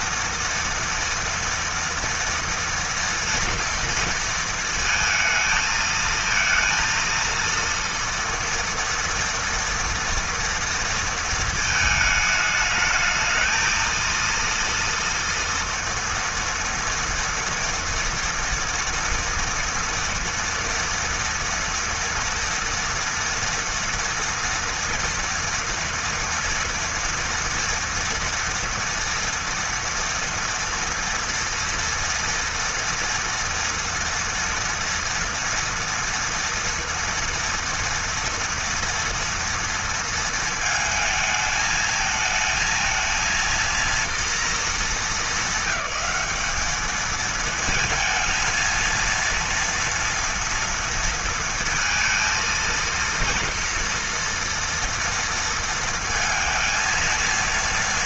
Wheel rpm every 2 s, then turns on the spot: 230, 230, 230, 230, 230, 230, 220, 230, 230, 230, 230, 230, 230, 230, 230, 230, 230, 230, 230, 230, 220, 230, 200, 220, 230, 230, 230, 230, 230.
none